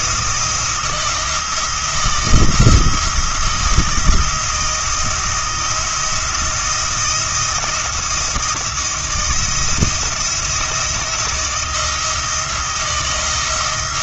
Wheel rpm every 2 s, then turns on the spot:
170, 170, 170, 170, 170, 170, 160.
none